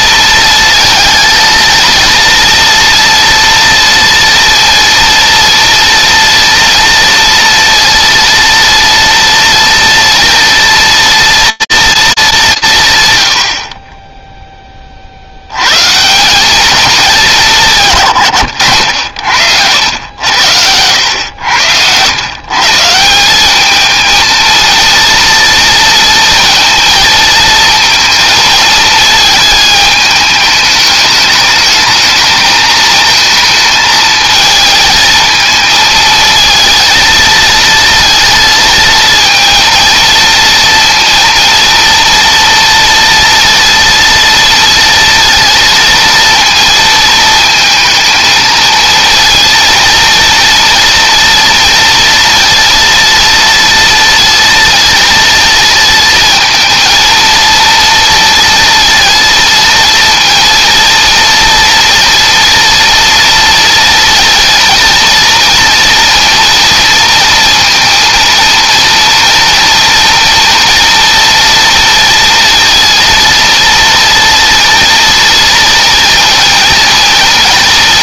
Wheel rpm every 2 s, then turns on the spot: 230, 230, 230, 230, 230, 230, 130, 50, 210, 90, 100, 160, 230, 230, 220, 210, 220, 220, 230, 230, 230, 230, 230, 230, 230, 230, 230, 230, 220, 230, 230, 240, 240, 230, 230, 230, 230, 230, 230.
none